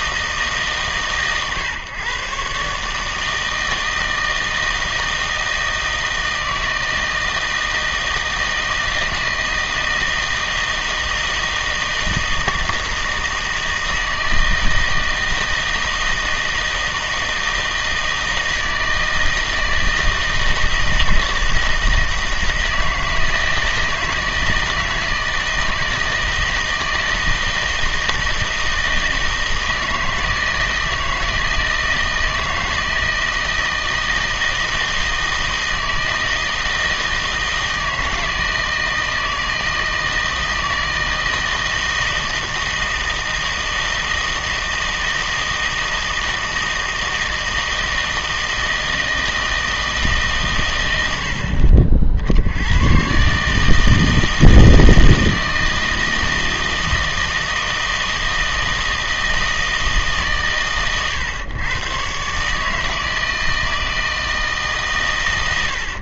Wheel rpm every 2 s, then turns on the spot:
140, 140, 160, 160, 160, 160, 160, 160, 160, 160, 160, 160, 160, 160, 160, 160, 160, 160, 160, 160, 160, 160, 160, 160, 160, 100, 100, 160, 160, 160, 120, 160, 140.
none